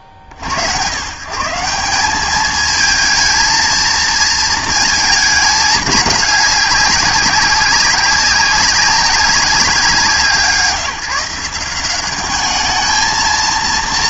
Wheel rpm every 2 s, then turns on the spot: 50, 210, 220, 210, 190, 170, 210.
none